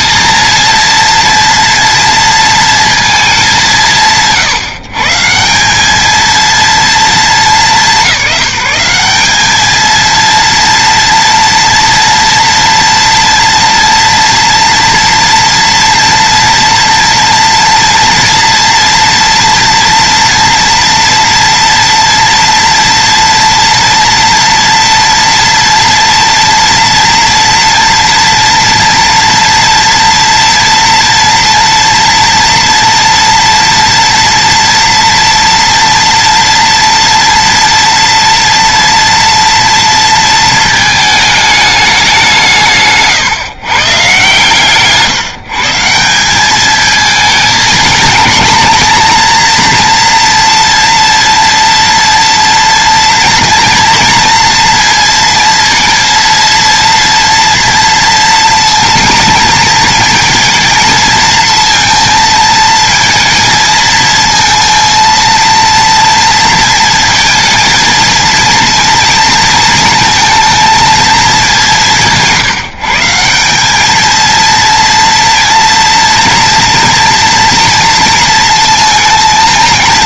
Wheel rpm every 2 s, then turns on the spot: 230, 230, 160, 230, 190, 230, 230, 230, 230, 230, 230, 230, 230, 240, 230, 230, 230, 230, 230, 230, 230, 150, 140, 210, 230, 230, 230, 230, 230, 230, 230, 220, 230, 230, 230, 230, 160, 230, 230, 230.
42-46